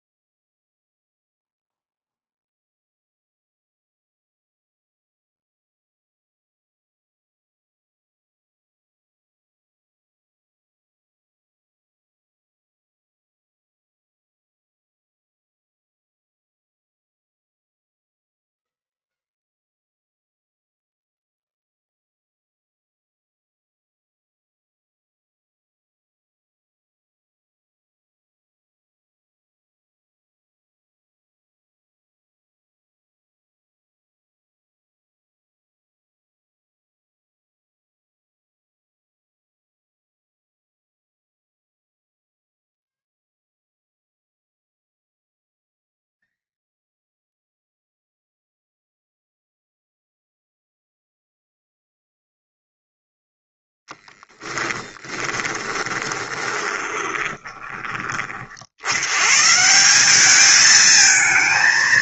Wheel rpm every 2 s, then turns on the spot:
0, 0, 0, 0, 0, 0, 0, 0, 0, 0, 0, 0, 0, 0, 0, 0, 0, 0, 0, 0, 0, 0, 0, 0, 0, 0, 0, 20, 20, 70, 220.
54-58